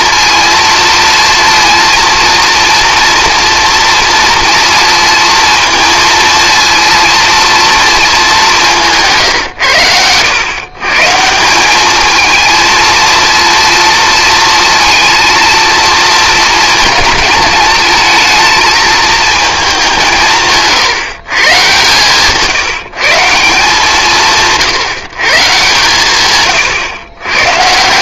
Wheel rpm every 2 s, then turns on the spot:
230, 230, 230, 230, 180, 130, 220, 230, 230, 220, 150, 160, 160, 120.
none